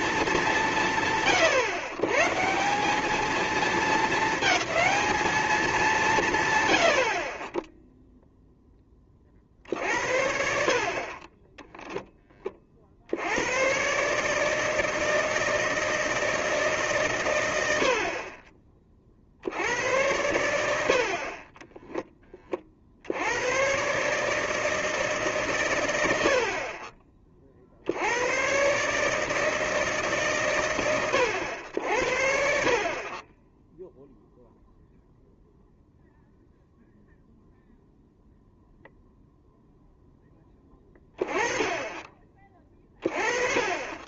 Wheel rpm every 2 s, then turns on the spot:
200, 160, 220, 100, 10, 60, 30, 160, 160, 30, 80, 30, 160, 50, 110, 120, 60, 0, 0, 0, 20, 30.
none